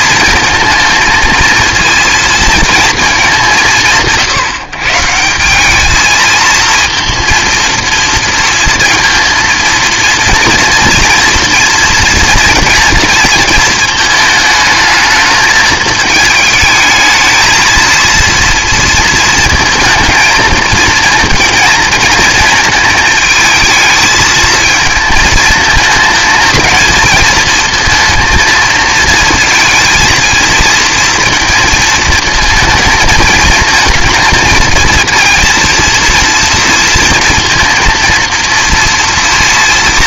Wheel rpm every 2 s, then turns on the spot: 230, 230, 130, 230, 230, 230, 230, 220, 220, 230, 230, 230, 220, 220, 220, 230, 220, 230, 230, 230.
none